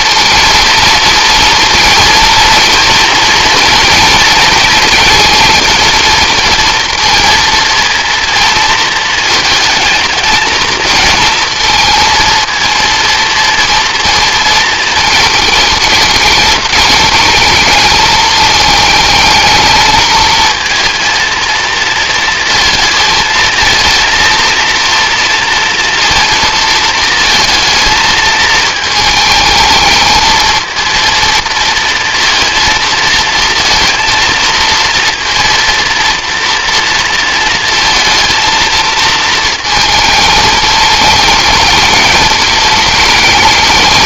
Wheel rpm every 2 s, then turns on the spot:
230, 230, 230, 230, 230, 230, 230, 220, 210, 220, 230, 230, 230, 220, 220, 230, 230, 230, 230, 220, 220, 210.
none